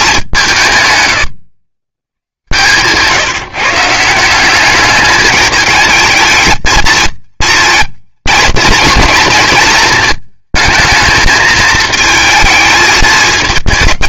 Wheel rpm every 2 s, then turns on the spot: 150, 120, 200, 230, 230, 230, 220.
none